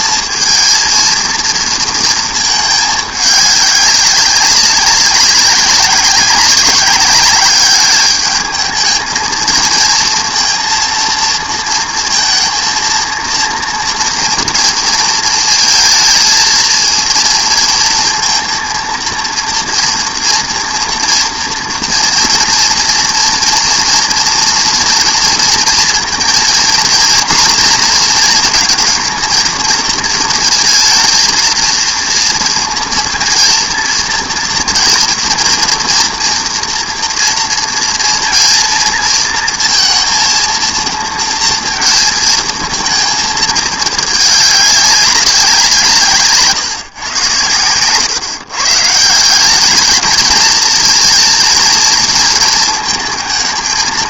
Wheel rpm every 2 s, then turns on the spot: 220, 220, 190, 200, 220, 230, 230, 230, 230, 230, 230, 230, 230, 230, 230, 230, 230, 230, 230, 230, 230, 220, 200, 140, 140, 230, 220.
none